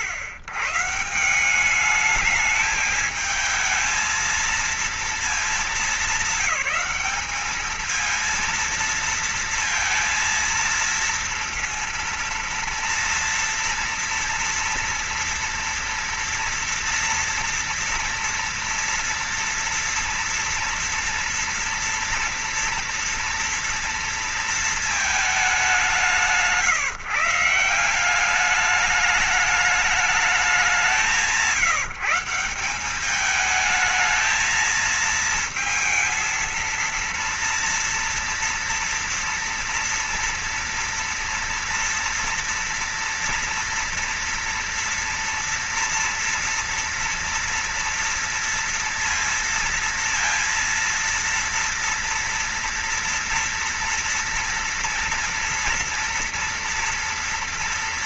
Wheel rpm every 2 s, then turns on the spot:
120, 210, 230, 210, 220, 230, 230, 230, 230, 230, 230, 230, 230, 160, 190, 210, 190, 220, 230, 230, 240, 230, 230, 230, 230, 230, 230, 230, 240.
none